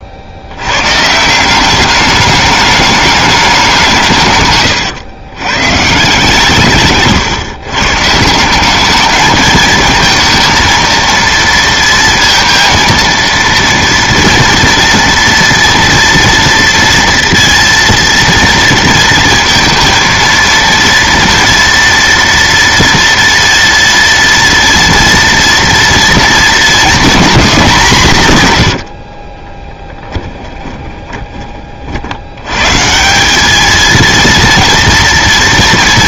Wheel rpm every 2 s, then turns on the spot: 80, 210, 120, 150, 190, 230, 230, 230, 230, 230, 230, 230, 230, 220, 120, 20, 120, 230.
28-32